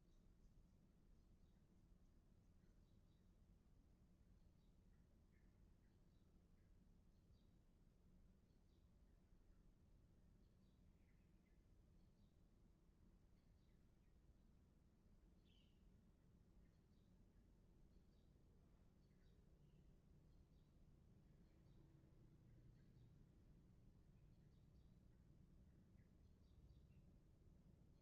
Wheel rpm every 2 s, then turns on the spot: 0, 0, 0, 0, 0, 0, 0, 0, 0, 0, 0, 0, 0, 0.
none